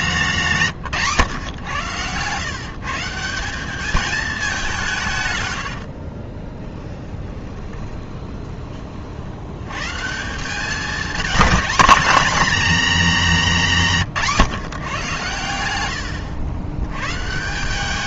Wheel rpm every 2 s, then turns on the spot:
160, 160, 180, 10, 40, 220, 250, 130, 100.
6-8